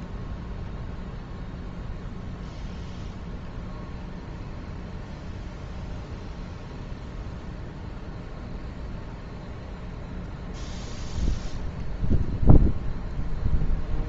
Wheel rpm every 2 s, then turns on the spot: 0, 0, 0, 0, 0, 0, 0.
none